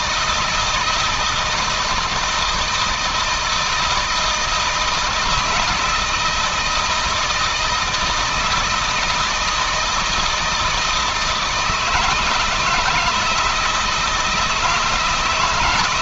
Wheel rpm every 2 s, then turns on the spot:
160, 160, 160, 160, 160, 160, 160, 160.
none